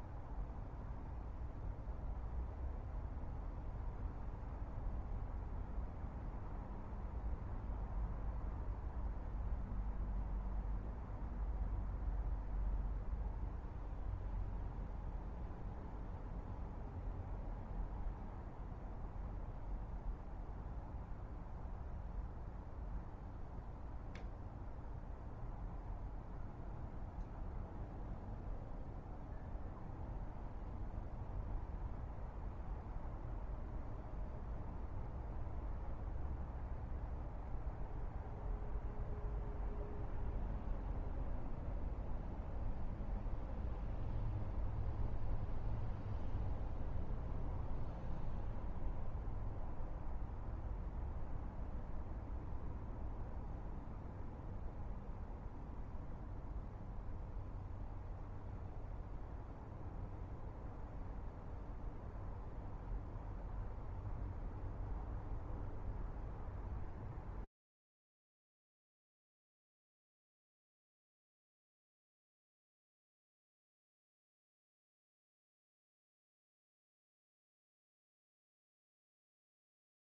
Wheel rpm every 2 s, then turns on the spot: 0, 0, 0, 0, 0, 0, 0, 0, 0, 0, 0, 0, 0, 0, 0, 0, 0, 0, 0, 0, 0, 0, 0, 0, 0, 0, 0, 0, 0, 0, 0, 0, 0, 0, 0, 0, 0, 0, 0, 0.
none